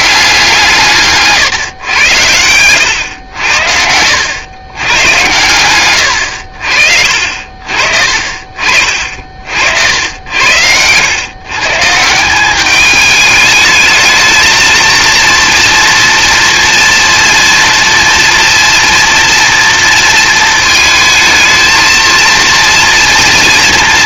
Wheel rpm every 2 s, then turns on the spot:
140, 90, 110, 60, 50, 110, 210, 230, 230, 230, 220, 230.
none